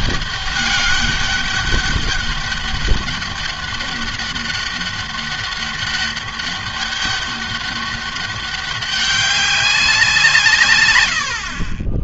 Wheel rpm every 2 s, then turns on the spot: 200, 200, 200, 200, 200, 120.
none